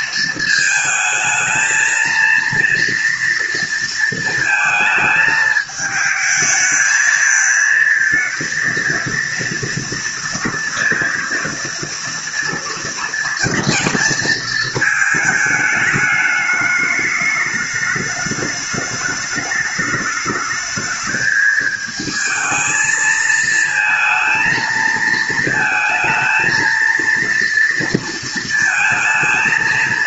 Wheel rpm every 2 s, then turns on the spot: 220, 230, 220, 220, 230, 230, 230, 220, 210, 210, 220, 220, 230, 230, 230.
none